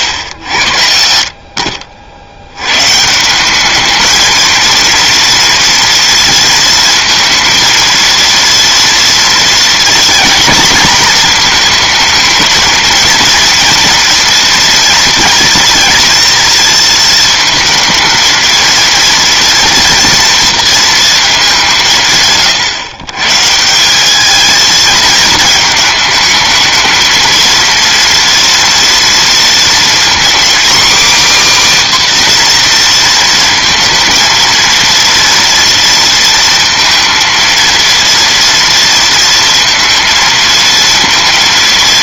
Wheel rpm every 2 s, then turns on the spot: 80, 120, 230, 230, 230, 240, 220, 230, 230, 230, 230, 130, 220, 220, 230, 270, 240, 230, 230, 230, 230.
none